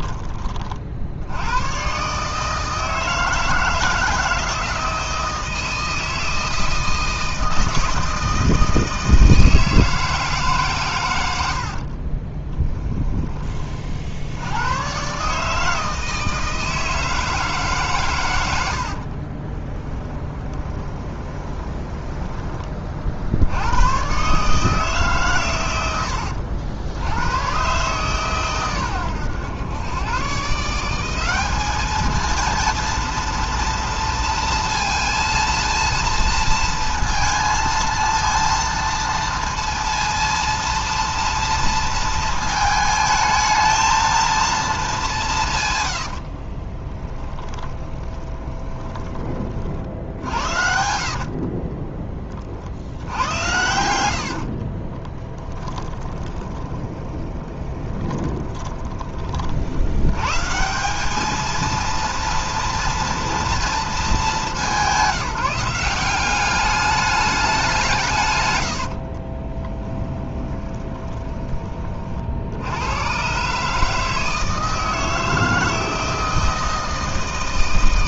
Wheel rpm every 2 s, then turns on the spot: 30, 160, 160, 160, 160, 130, 20, 110, 160, 80, 20, 30, 150, 80, 120, 180, 230, 230, 230, 230, 230, 220, 210, 20, 20, 60, 70, 40, 20, 20, 180, 230, 180, 200, 90, 10, 90, 160, 160.
12-14 20-22 46-50 54-58 68-72